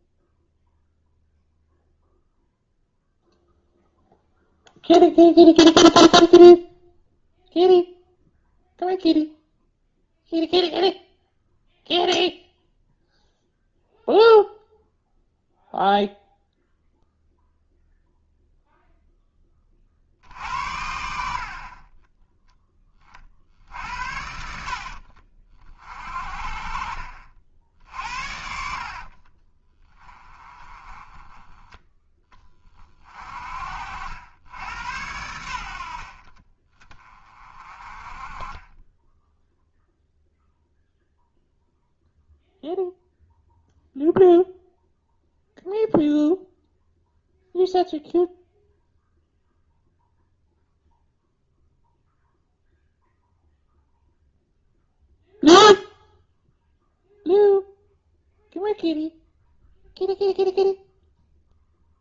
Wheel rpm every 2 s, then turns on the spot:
0, 0, 0, 0, 0, 0, 0, 0, 0, 0, 70, 10, 60, 50, 50, 20, 30, 90, 30, 10, 0, 0, 0, 0, 0, 0, 0, 0, 0, 0, 0.
24-26 28-30